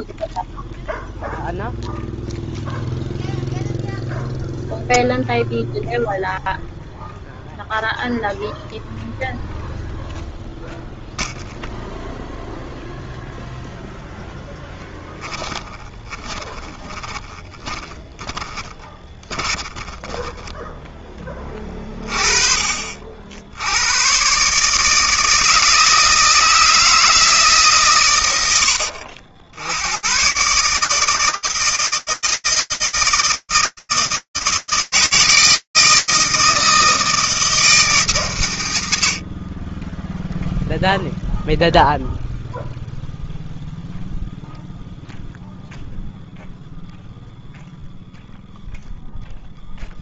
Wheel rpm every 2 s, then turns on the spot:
0, 0, 0, 0, 0, 0, 0, 10, 20, 20, 10, 50, 150, 160, 80, 160, 160, 160, 160, 120, 0, 0, 0, 0, 0.
14-20